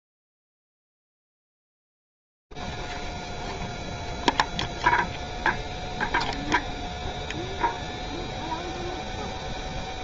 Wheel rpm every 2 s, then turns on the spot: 0, 0, 0, 0, 0.
none